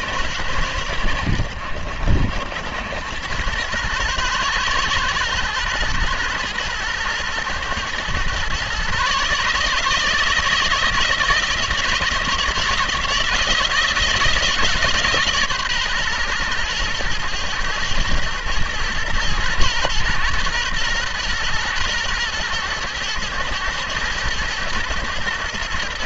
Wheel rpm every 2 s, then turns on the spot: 100, 90, 110, 120, 130, 160, 160, 160, 120, 110, 120, 110, 120.
none